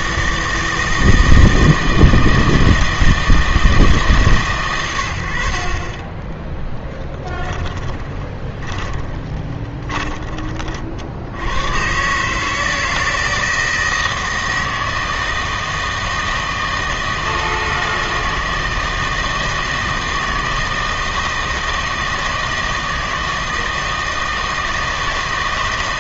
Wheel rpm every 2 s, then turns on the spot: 160, 160, 120, 10, 20, 30, 160, 160, 160, 160, 160, 160, 160.
6-10